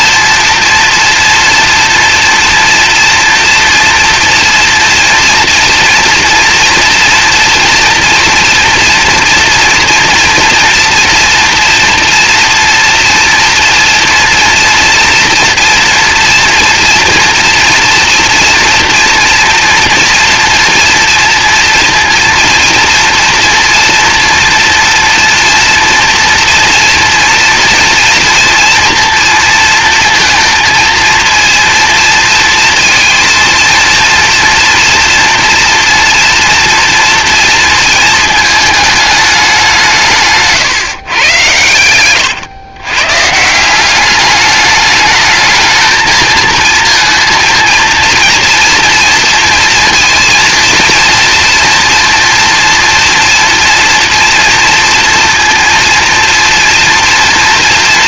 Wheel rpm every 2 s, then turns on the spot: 240, 230, 230, 240, 240, 230, 230, 230, 240, 230, 230, 230, 230, 230, 230, 230, 230, 240, 230, 220, 140, 120, 210, 220, 230, 230, 240, 240, 240.
none